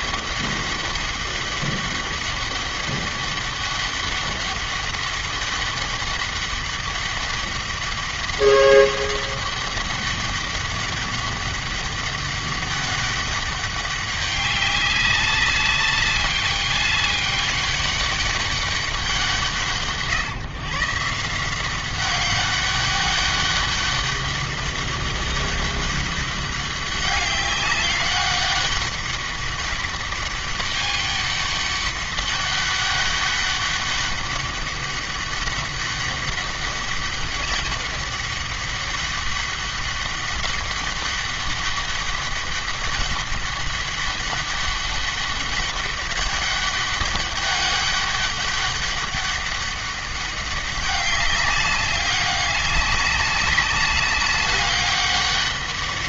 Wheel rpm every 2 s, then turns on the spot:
200, 200, 200, 200, 200, 200, 200, 200, 200, 200, 150, 200, 200, 200, 200, 200, 200, 200, 200, 200, 200, 200, 200, 200, 200, 200, 200, 200.
none